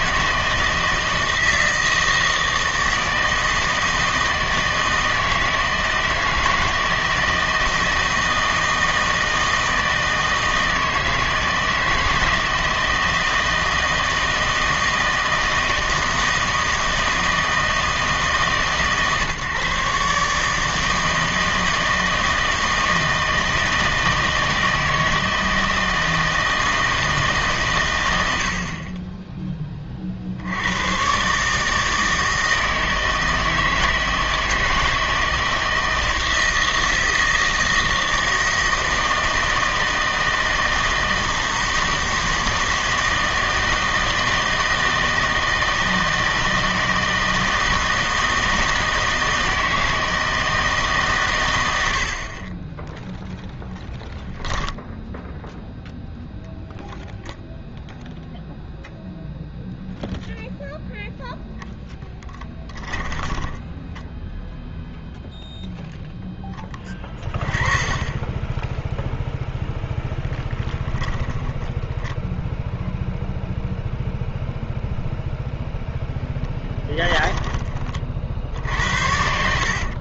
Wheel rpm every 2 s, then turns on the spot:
160, 160, 160, 160, 160, 160, 160, 160, 160, 150, 160, 160, 160, 160, 40, 90, 160, 160, 160, 160, 160, 160, 160, 160, 160, 160, 20, 0, 0, 0, 0, 10, 0, 20, 10, 10, 0, 0, 20, 60.
62-64 76-80